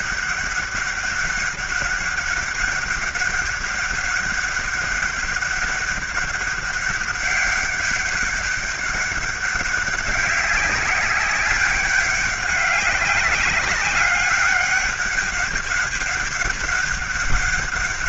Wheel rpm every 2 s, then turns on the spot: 200, 200, 200, 200, 200, 190, 190, 200, 200.
none